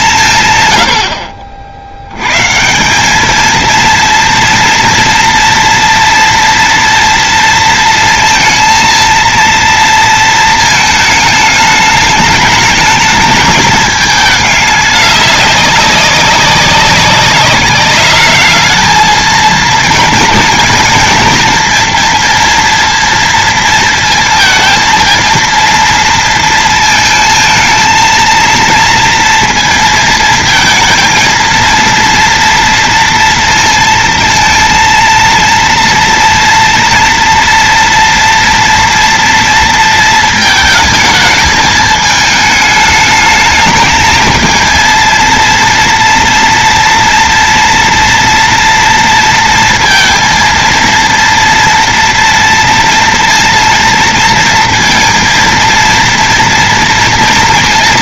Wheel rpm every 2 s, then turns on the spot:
110, 160, 230, 230, 230, 220, 210, 210, 190, 220, 230, 230, 230, 230, 230, 230, 230, 230, 230, 230, 220, 210, 230, 230, 230, 230, 230, 230, 230.
none